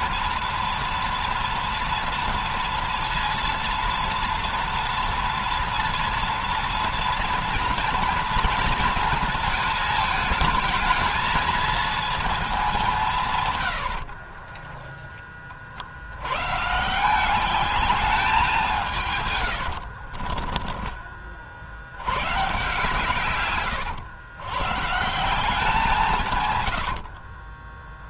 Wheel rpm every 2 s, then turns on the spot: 230, 230, 230, 230, 230, 220, 220, 40, 120, 190, 30, 130, 120, 120.
20-22 26-28